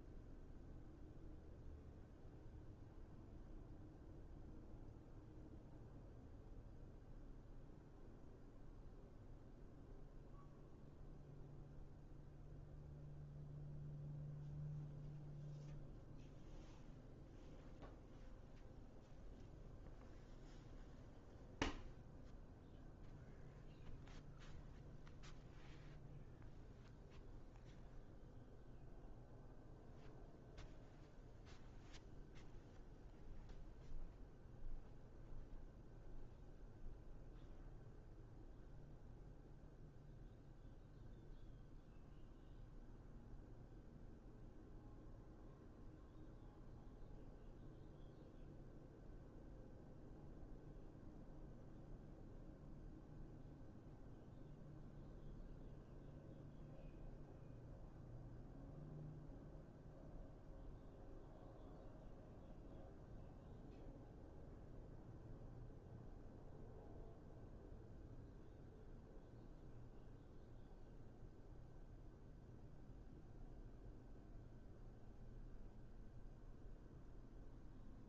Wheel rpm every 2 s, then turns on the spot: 0, 0, 0, 0, 0, 0, 0, 0, 0, 0, 0, 0, 0, 0, 0, 0, 0, 0, 0, 0, 0, 0, 0, 0, 0, 0, 0, 0, 0, 0, 0, 0, 0, 0, 0, 0, 0, 0, 0.
none